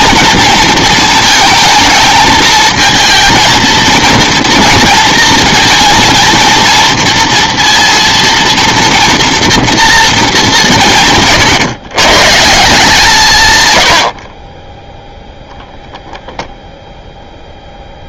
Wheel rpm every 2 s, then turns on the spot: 230, 220, 230, 230, 230, 180, 170, 10, 0.
none